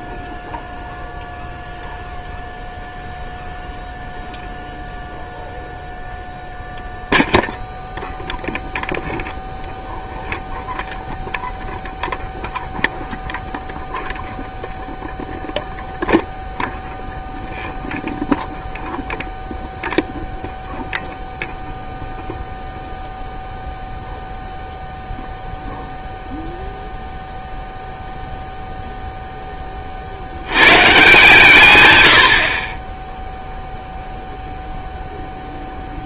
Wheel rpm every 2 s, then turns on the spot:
0, 0, 0, 0, 0, 0, 0, 0, 0, 0, 0, 0, 0, 0, 0, 130, 50, 0.
32-34